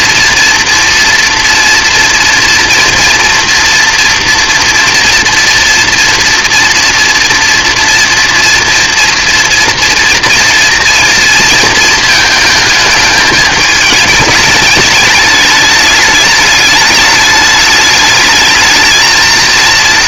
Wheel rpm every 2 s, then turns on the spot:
240, 230, 240, 230, 230, 230, 220, 210, 210, 220.
none